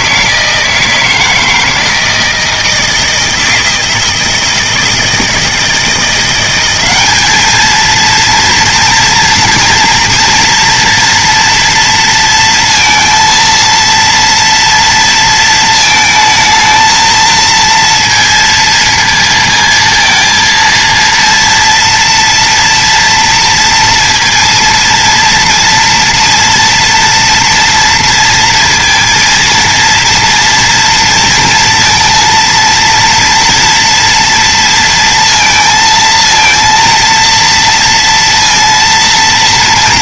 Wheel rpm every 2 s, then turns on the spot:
170, 160, 160, 190, 230, 230, 230, 230, 220, 230, 230, 230, 230, 230, 230, 230, 230, 230, 230, 230.
none